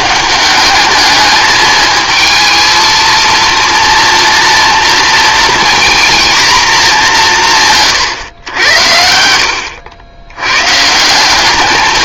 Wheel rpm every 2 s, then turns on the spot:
200, 220, 230, 220, 90, 140.
none